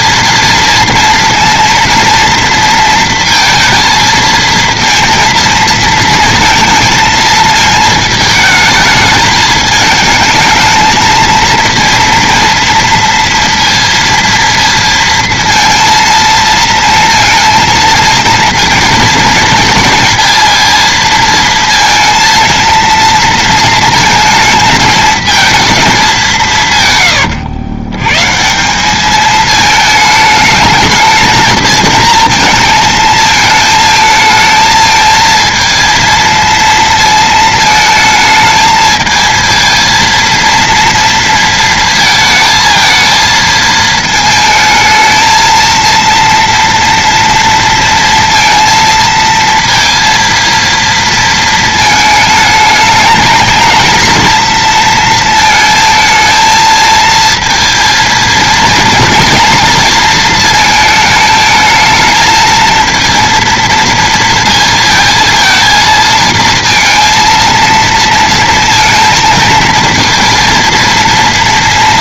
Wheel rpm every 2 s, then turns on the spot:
230, 230, 230, 220, 220, 220, 230, 230, 230, 230, 230, 230, 220, 140, 190, 220, 220, 220, 230, 220, 230, 220, 220, 230, 230, 230, 220, 230, 220, 230, 220, 220, 230, 220, 230, 230.
none